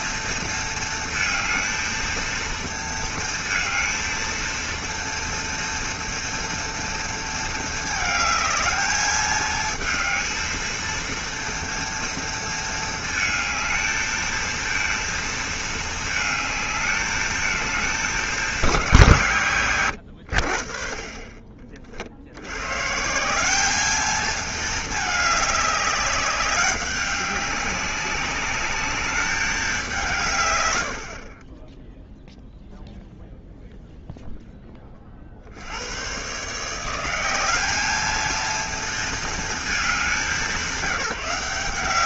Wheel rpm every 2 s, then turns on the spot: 230, 230, 230, 230, 220, 230, 230, 230, 220, 180, 50, 120, 220, 200, 210, 90, 0, 20, 160, 230, 190.
none